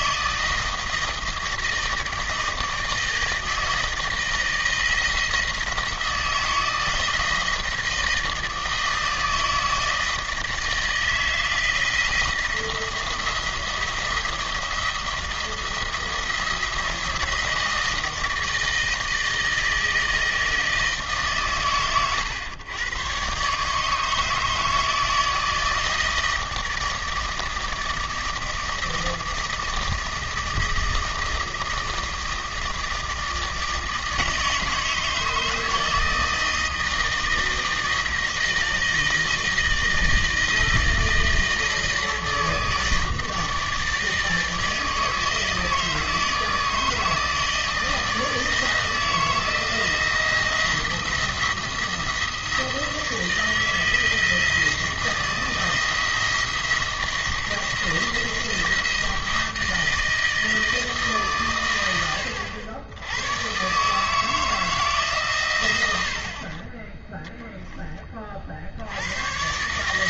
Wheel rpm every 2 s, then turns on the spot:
160, 160, 160, 160, 160, 160, 170, 170, 170, 160, 160, 110, 160, 160, 160, 160, 160, 160, 160, 160, 160, 160, 160, 160, 160, 170, 160, 170, 170, 170, 160, 90, 160, 30, 70.
none